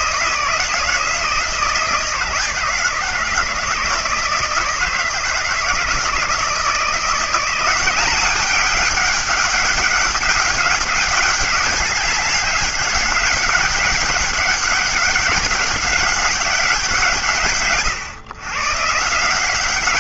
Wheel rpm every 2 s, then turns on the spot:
160, 160, 160, 170, 200, 200, 200, 200, 180, 140.
none